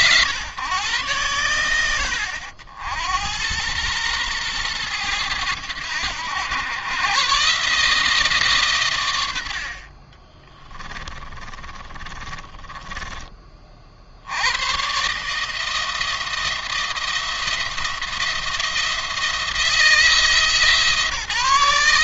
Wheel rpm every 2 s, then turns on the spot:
130, 80, 110, 100, 130, 30, 20, 110, 160, 170, 150.
10-14